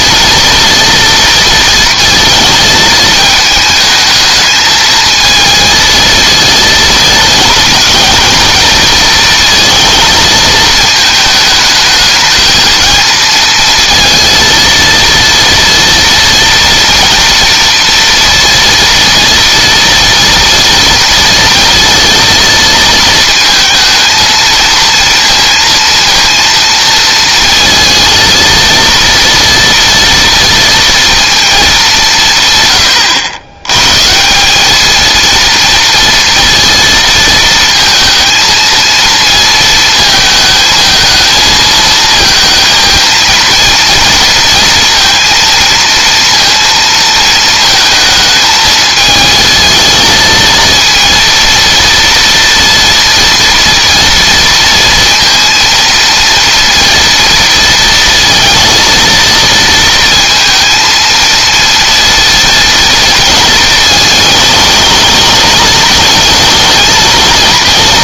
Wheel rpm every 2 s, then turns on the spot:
230, 220, 220, 220, 230, 220, 230, 230, 230, 230, 230, 230, 230, 230, 230, 230, 120, 210, 230, 220, 220, 230, 230, 230, 220, 230, 240, 230, 230, 230, 230, 230, 220, 220.
none